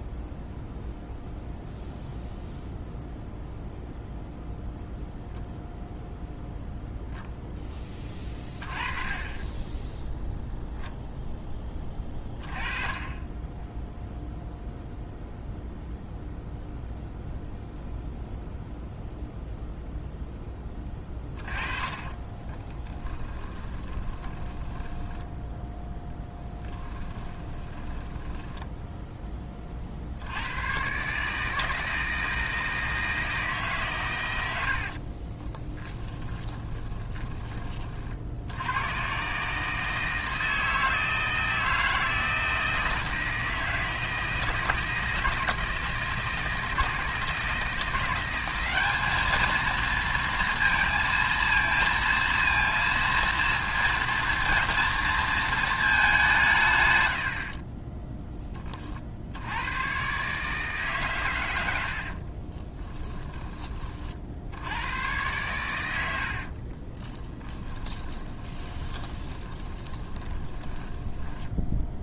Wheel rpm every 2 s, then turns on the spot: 0, 0, 0, 0, 30, 0, 30, 0, 0, 0, 10, 20, 10, 10, 10, 120, 160, 70, 20, 100, 160, 160, 160, 160, 200, 230, 230, 230, 120, 40, 140, 20, 90, 30, 20, 10.
20-30 34-38 62-64 66-72